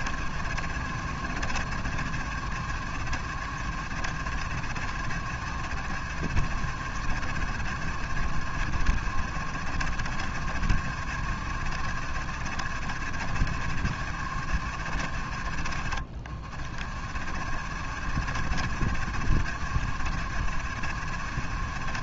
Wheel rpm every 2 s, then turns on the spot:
70, 70, 60, 70, 70, 70, 70, 60, 50, 70, 70.
none